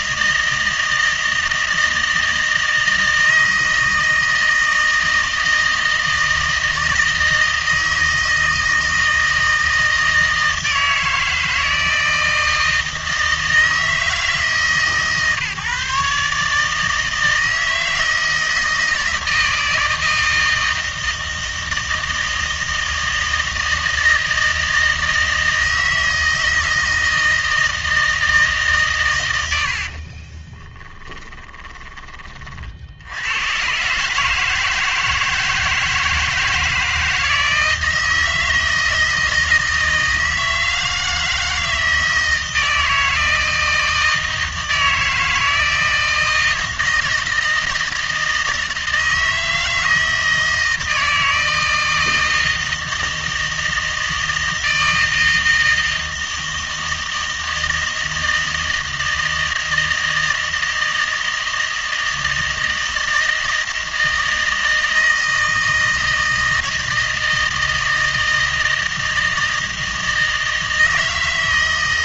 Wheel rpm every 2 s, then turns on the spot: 160, 160, 160, 160, 160, 160, 160, 150, 150, 160, 160, 160, 160, 160, 150, 10, 50, 160, 160, 160, 160, 160, 160, 160, 160, 160, 160, 160, 160, 160, 160, 160, 160, 160, 160, 160.
30-32